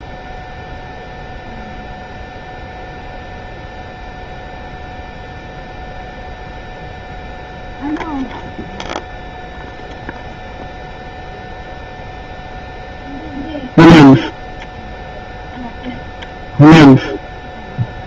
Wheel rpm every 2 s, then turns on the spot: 0, 0, 0, 0, 0, 0, 0, 0, 0.
none